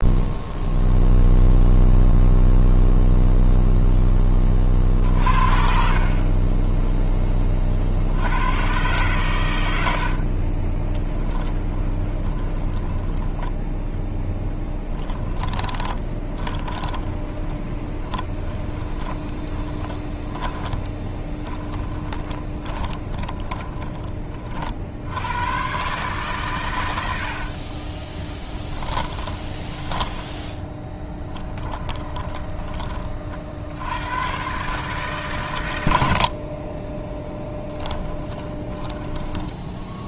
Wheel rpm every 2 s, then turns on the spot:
0, 0, 40, 10, 120, 20, 20, 20, 20, 20, 30, 20, 60, 100, 10, 10, 20, 140, 20, 20.
10-12 14-24 28-32 38-40